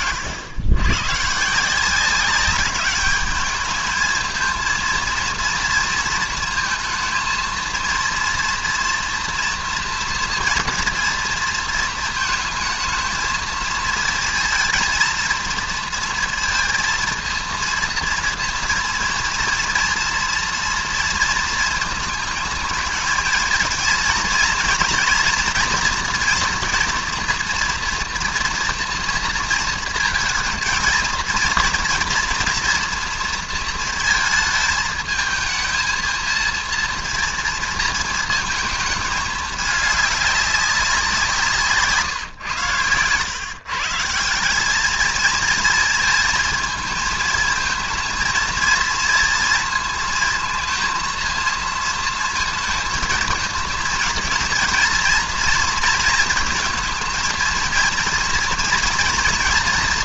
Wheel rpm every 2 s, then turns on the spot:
110, 200, 230, 220, 230, 230, 220, 220, 230, 230, 230, 220, 230, 230, 230, 230, 230, 220, 230, 220, 200, 110, 200, 220, 230, 230, 220, 230, 230, 240.
none